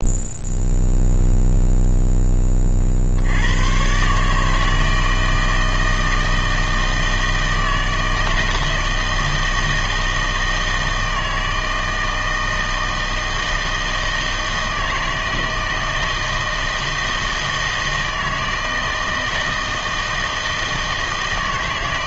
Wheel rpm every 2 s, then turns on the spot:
0, 40, 160, 160, 160, 160, 160, 160, 160, 160, 160.
none